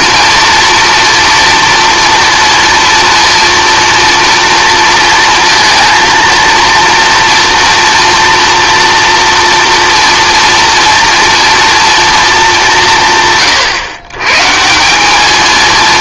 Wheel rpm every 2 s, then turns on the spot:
230, 230, 230, 230, 230, 230, 190, 150.
none